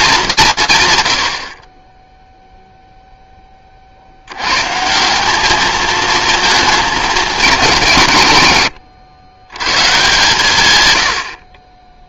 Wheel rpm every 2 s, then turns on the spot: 160, 0, 120, 220, 130, 130.
none